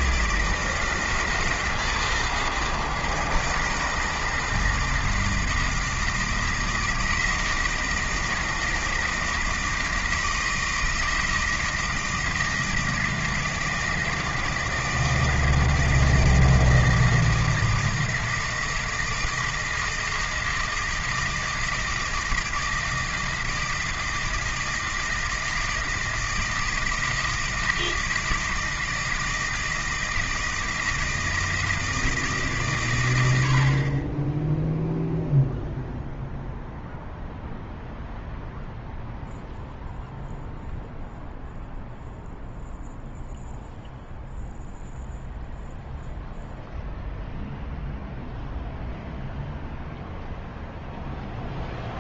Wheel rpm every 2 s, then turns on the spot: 160, 160, 160, 160, 160, 160, 160, 160, 160, 160, 160, 160, 160, 160, 160, 160, 140, 0, 0, 0, 0, 0, 0, 0, 0, 0.
none